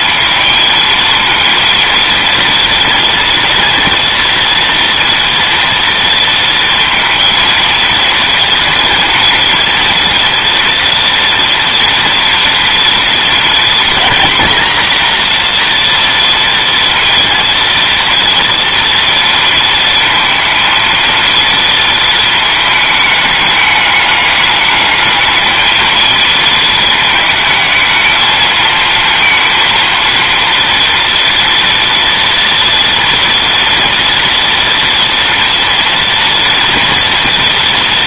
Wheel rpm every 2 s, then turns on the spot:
230, 230, 240, 230, 230, 230, 230, 230, 230, 230, 230, 220, 210, 220, 220, 230, 230, 230, 230.
none